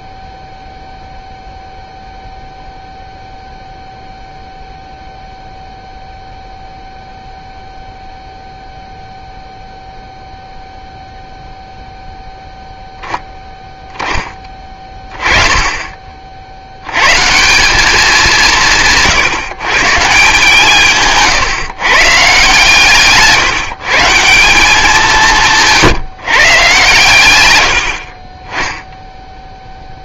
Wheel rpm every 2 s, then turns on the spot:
0, 0, 0, 0, 0, 0, 0, 10, 60, 170, 160, 150, 180, 140, 20.
none